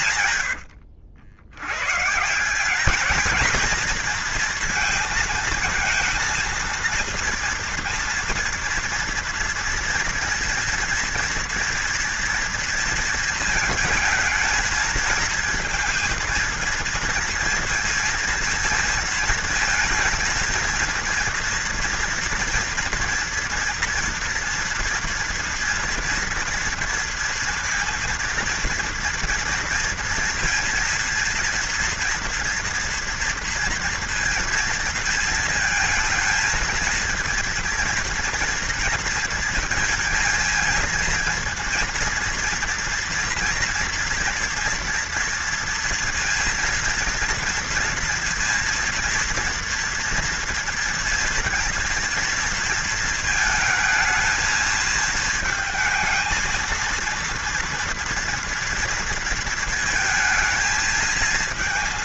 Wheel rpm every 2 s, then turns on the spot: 110, 180, 220, 230, 230, 240, 230, 220, 230, 230, 230, 230, 240, 230, 230, 230, 230, 230, 230, 230, 220, 230, 230, 230, 230, 230, 230, 220, 230, 230, 220.
0-2